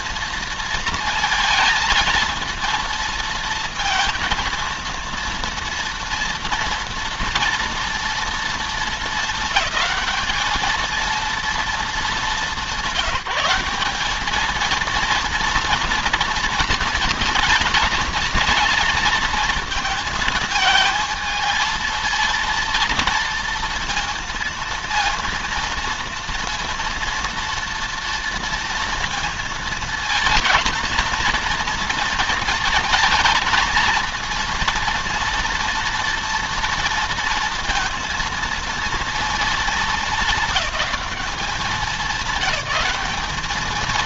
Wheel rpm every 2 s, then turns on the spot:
230, 220, 230, 240, 230, 220, 190, 230, 230, 230, 220, 230, 230, 230, 230, 220, 230, 230, 230, 230, 200, 220.
none